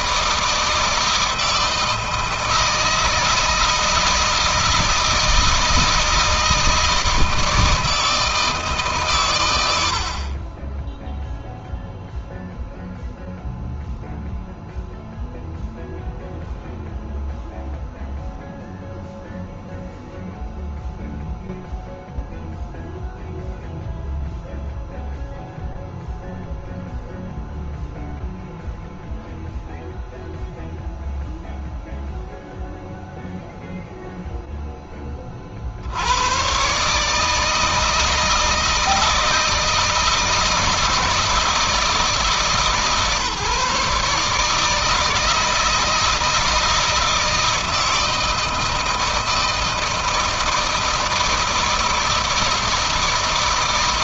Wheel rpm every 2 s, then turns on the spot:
160, 160, 160, 160, 120, 0, 0, 0, 0, 0, 0, 0, 0, 0, 0, 0, 0, 30, 150, 160, 160, 150, 160, 160, 160, 160, 160.
none